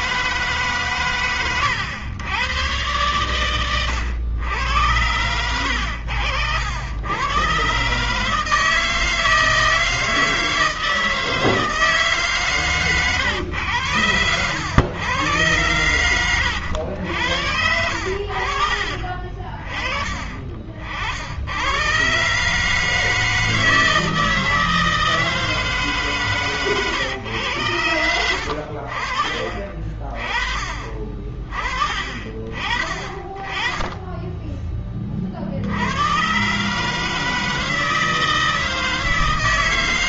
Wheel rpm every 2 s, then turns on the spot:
150, 110, 120, 100, 160, 160, 140, 100, 100, 60, 40, 140, 160, 140, 80, 30, 40, 20, 130, 160.
18-20 26-28